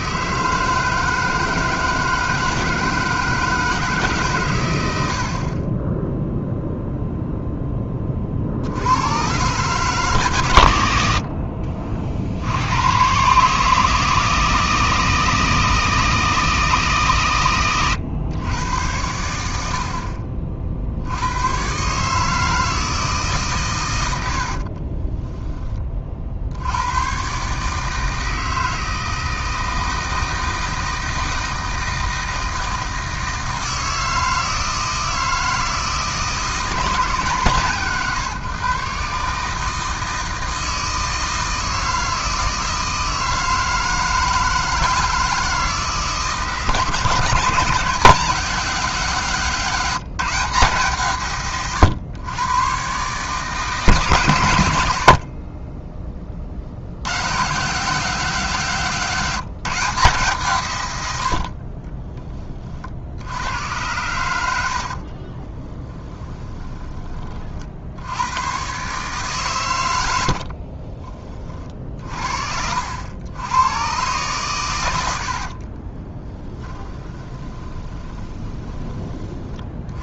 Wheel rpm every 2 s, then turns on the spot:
160, 160, 100, 0, 80, 100, 100, 160, 160, 100, 50, 160, 40, 100, 160, 160, 160, 160, 160, 140, 160, 160, 160, 150, 180, 160, 130, 70, 70, 160, 110, 40, 80, 20, 130, 40, 80, 110, 20, 30.
24-26 64-68 70-72 76-78